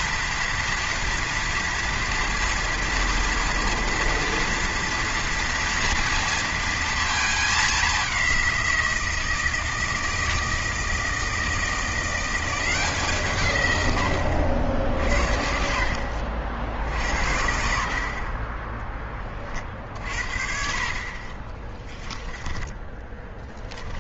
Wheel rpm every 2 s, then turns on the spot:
230, 230, 240, 230, 180, 160, 180, 80, 70, 20, 50, 10.
none